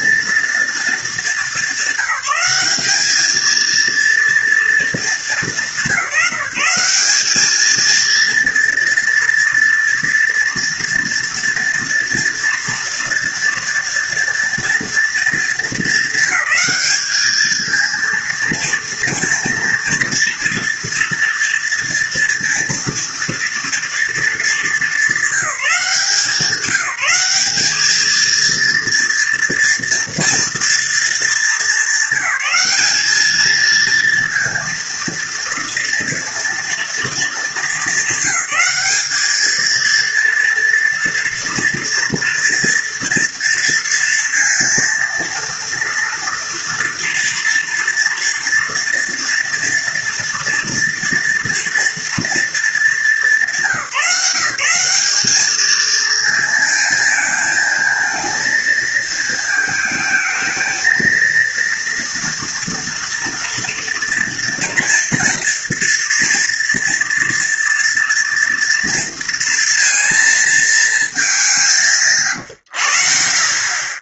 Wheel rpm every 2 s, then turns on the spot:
220, 210, 210, 200, 240, 230, 230, 230, 210, 230, 230, 230, 200, 190, 230, 220, 210, 230, 220, 210, 240, 230, 230, 230, 230, 240, 210, 190, 230, 230, 230, 230, 230, 230, 230, 220, 70.
none